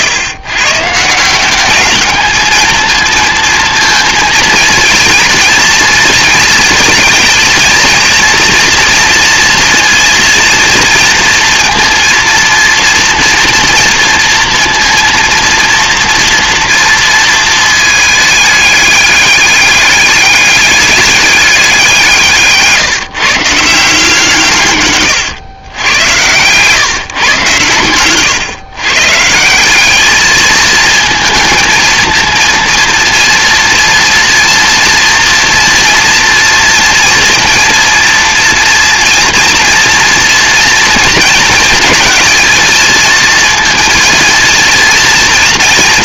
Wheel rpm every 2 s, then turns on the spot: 150, 230, 230, 230, 230, 230, 230, 230, 230, 210, 200, 150, 130, 130, 130, 220, 230, 230, 230, 240, 230, 230, 230.
none